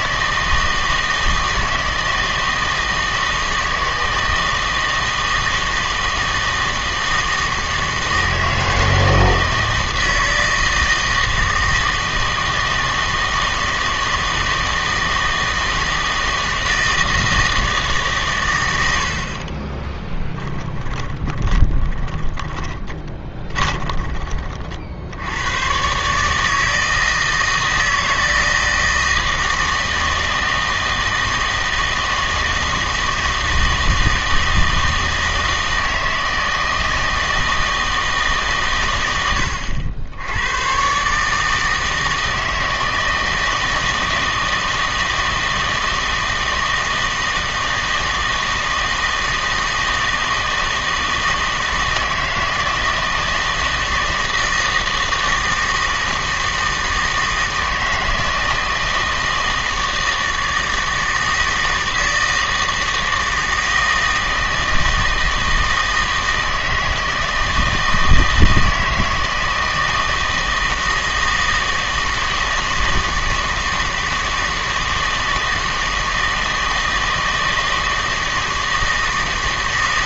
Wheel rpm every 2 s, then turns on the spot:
160, 160, 160, 160, 160, 160, 160, 160, 160, 100, 10, 20, 50, 160, 160, 160, 160, 160, 160, 130, 110, 160, 160, 160, 160, 160, 160, 160, 160, 160, 160, 160, 160, 160, 160, 160, 160, 160, 160, 160.
20-24